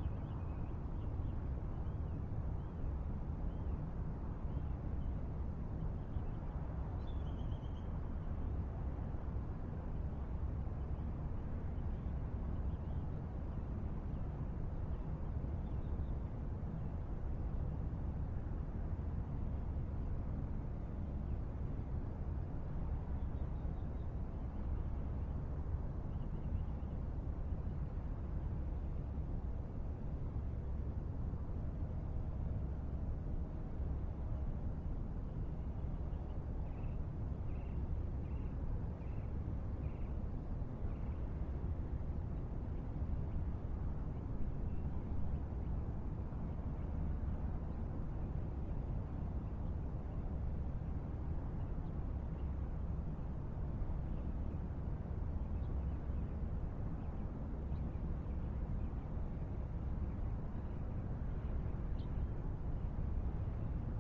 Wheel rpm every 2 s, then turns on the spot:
0, 0, 0, 0, 0, 0, 0, 0, 0, 0, 0, 0, 0, 0, 0, 0, 0, 0, 0, 0, 0, 0, 0, 0, 0, 0, 0, 0, 0, 0, 0, 0.
none